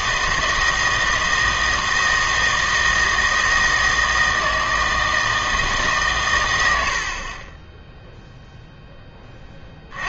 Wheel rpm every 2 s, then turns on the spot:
160, 160, 160, 90, 10.
none